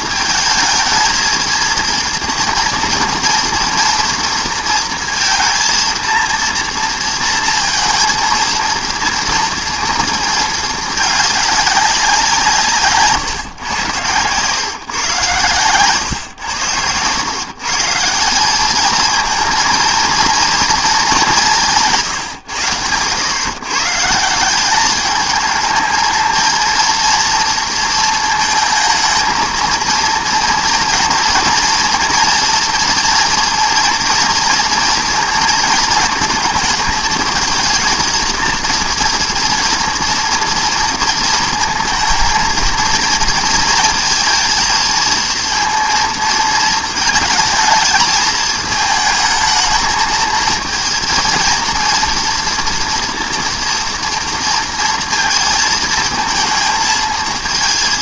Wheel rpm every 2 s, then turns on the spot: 220, 230, 230, 230, 230, 230, 180, 130, 120, 180, 230, 130, 170, 230, 220, 230, 230, 230, 220, 230, 230, 230, 230, 230, 220, 220, 230, 230, 220.
none